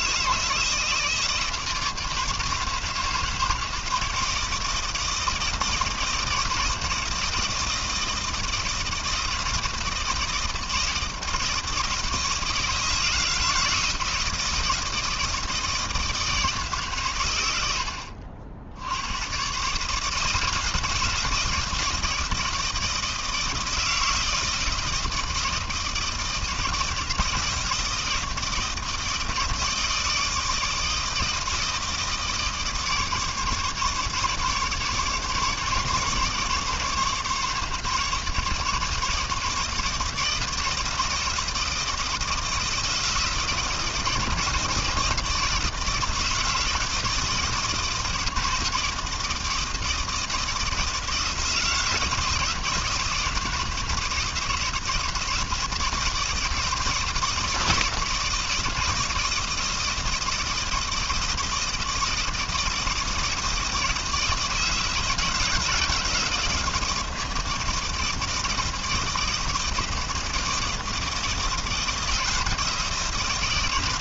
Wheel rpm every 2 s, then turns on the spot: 160, 150, 160, 160, 160, 160, 160, 160, 150, 80, 170, 160, 160, 160, 160, 160, 160, 150, 150, 150, 160, 160, 160, 160, 160, 160, 160, 160, 160, 160, 160, 160, 160, 160, 160, 170, 160.
none